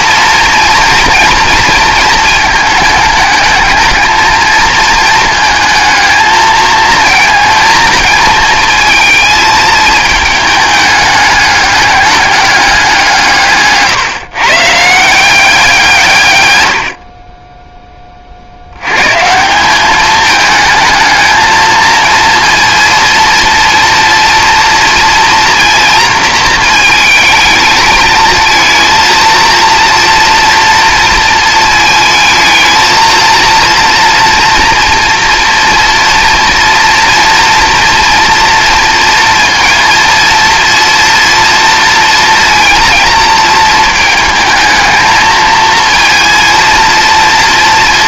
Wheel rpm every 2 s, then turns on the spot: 230, 220, 220, 220, 220, 210, 200, 150, 100, 90, 220, 230, 230, 230, 220, 230, 220, 240, 230, 230, 230, 230, 220, 230.
none